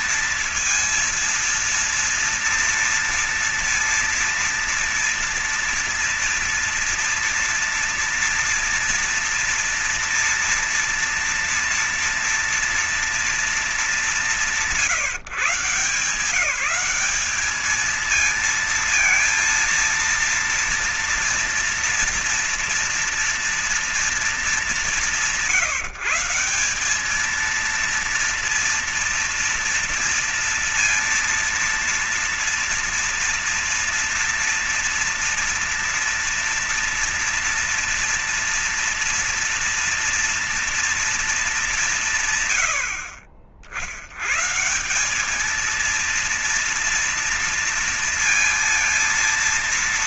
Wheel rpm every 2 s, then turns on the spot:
230, 230, 230, 230, 230, 240, 240, 160, 200, 230, 230, 230, 190, 190, 230, 230, 230, 240, 230, 240, 230, 80, 160, 230, 230.
none